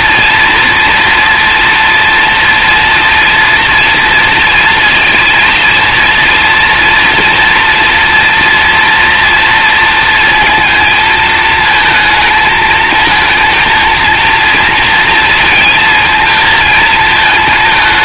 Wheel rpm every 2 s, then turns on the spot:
230, 230, 230, 230, 230, 220, 220, 230, 220.
none